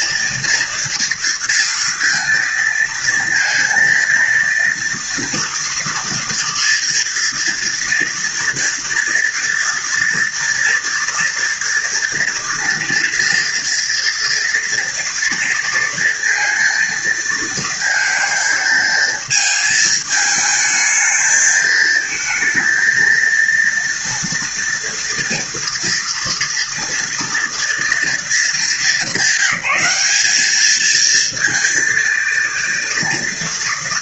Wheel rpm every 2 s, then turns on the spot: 230, 230, 230, 230, 230, 230, 230, 230, 230, 220, 220, 230, 230, 230, 200, 230, 230.
none